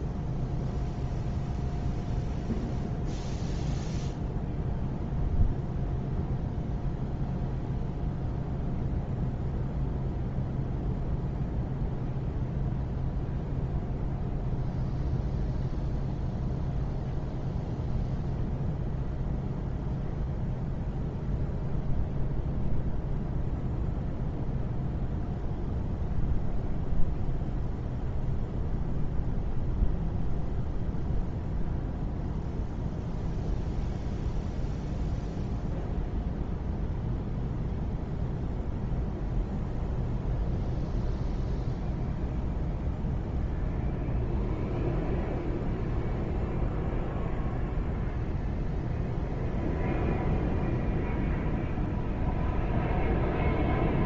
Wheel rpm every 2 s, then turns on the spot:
0, 0, 0, 0, 0, 0, 0, 0, 0, 0, 0, 0, 0, 0, 0, 0, 0, 0, 0, 0, 0, 0, 0, 0, 0, 0, 0.
none